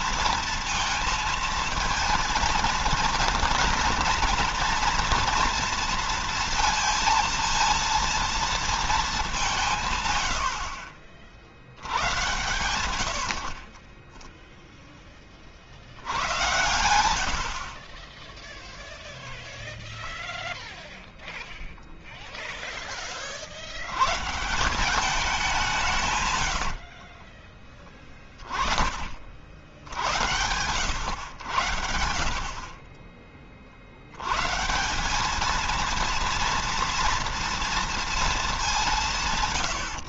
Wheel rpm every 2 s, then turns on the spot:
230, 230, 230, 230, 220, 60, 90, 10, 80, 0, 0, 20, 190, 60, 50, 100, 30, 180, 230, 190.
12-14 26-28 32-34